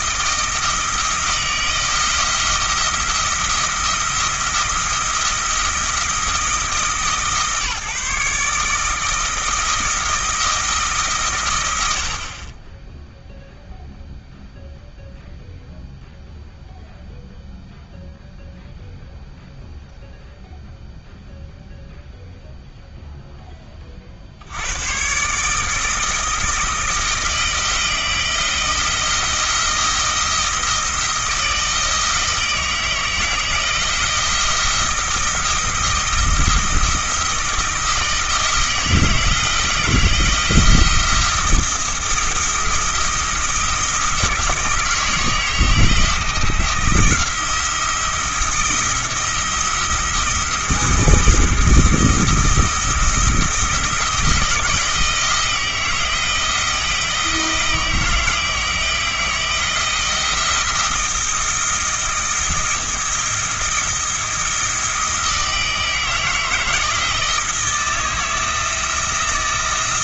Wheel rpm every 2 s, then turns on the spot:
160, 170, 170, 160, 160, 150, 10, 0, 0, 0, 0, 0, 100, 160, 170, 160, 160, 170, 170, 160, 170, 170, 160, 170, 160, 170, 170, 160, 170, 160, 170, 170, 160, 160, 170.
none